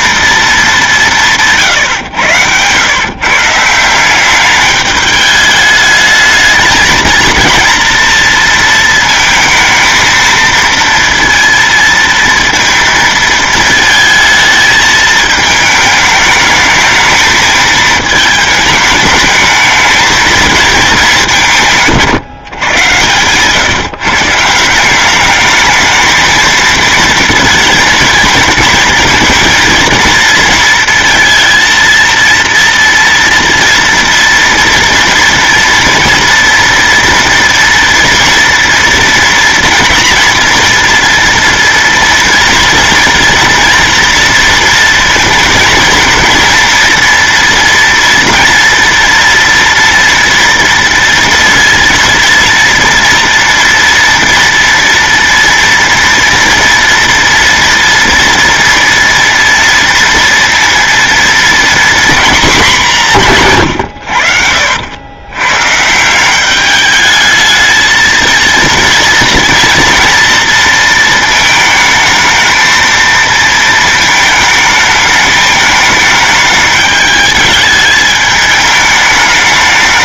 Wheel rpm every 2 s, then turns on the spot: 210, 110, 200, 220, 230, 230, 230, 220, 210, 210, 230, 130, 170, 230, 220, 230, 230, 230, 230, 240, 230, 230, 230, 230, 240, 230, 230, 230, 230, 230, 230, 230, 70, 200, 230, 230, 220, 220, 210, 210.
22-24 64-66